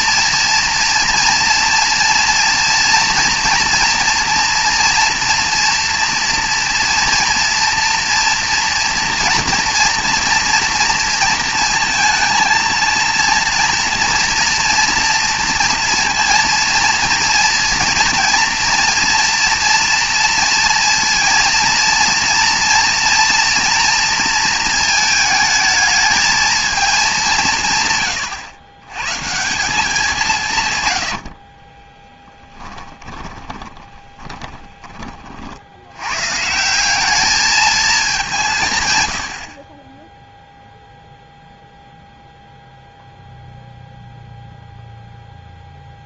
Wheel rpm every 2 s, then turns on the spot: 240, 230, 230, 230, 230, 230, 220, 230, 230, 230, 230, 230, 230, 220, 110, 140, 20, 20, 160, 150, 0, 0, 0.
32-36